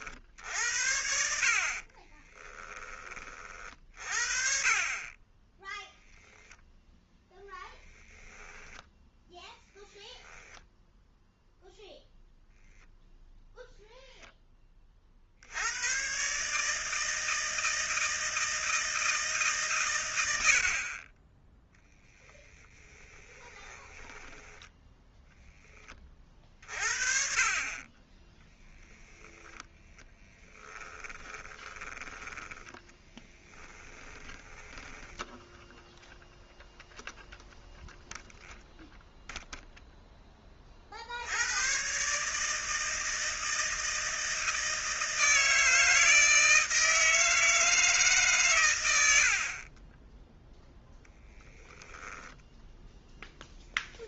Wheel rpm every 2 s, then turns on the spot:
60, 10, 40, 10, 0, 0, 0, 30, 160, 160, 50, 10, 10, 40, 0, 20, 20, 10, 0, 0, 40, 160, 160, 160, 120, 0, 0.
6-8 22-24 30-36